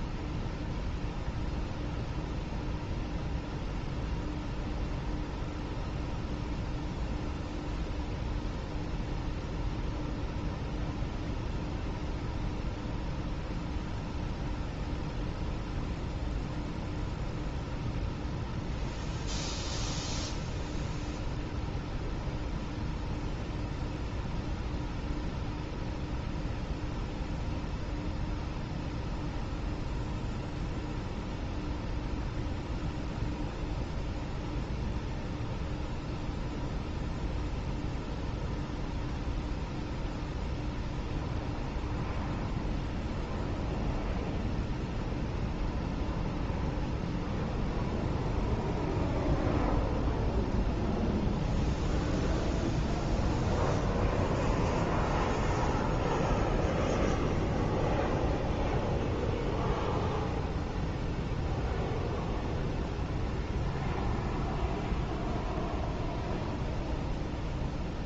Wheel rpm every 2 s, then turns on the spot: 0, 0, 0, 0, 0, 0, 0, 0, 0, 0, 0, 0, 0, 0, 0, 0, 0, 0, 0, 0, 0, 0, 0, 0, 0, 0, 0, 0, 0, 0, 0, 0, 0, 0.
none